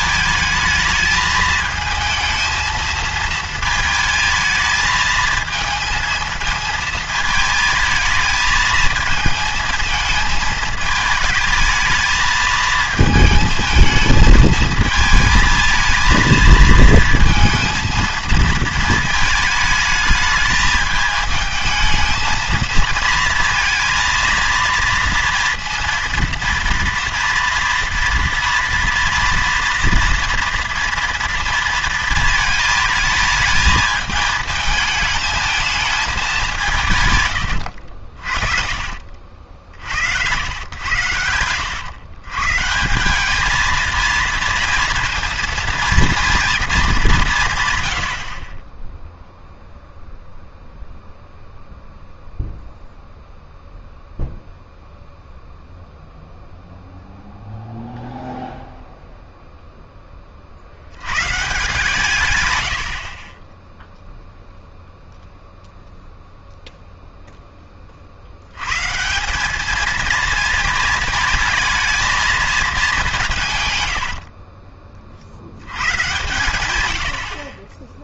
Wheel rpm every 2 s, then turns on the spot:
210, 220, 220, 230, 220, 220, 220, 220, 230, 220, 210, 220, 230, 230, 230, 230, 220, 220, 160, 70, 100, 160, 230, 210, 10, 0, 0, 0, 0, 0, 50, 100, 0, 0, 120, 230, 200, 30, 90.
38-40 74-76